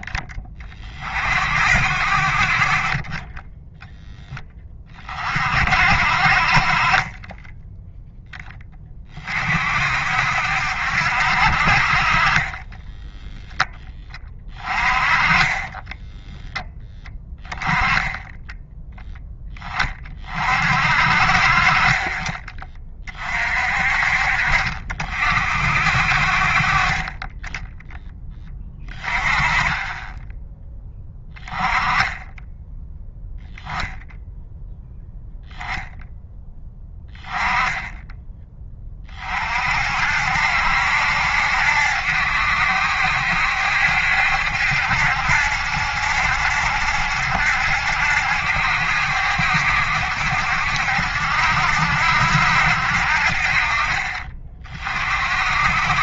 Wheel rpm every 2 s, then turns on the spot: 30, 40, 20, 40, 20, 70, 10, 20, 10, 0, 50, 30, 50, 30, 20, 10, 10, 0, 10, 20, 70, 70, 70, 70, 70, 70, 70, 40.
12-14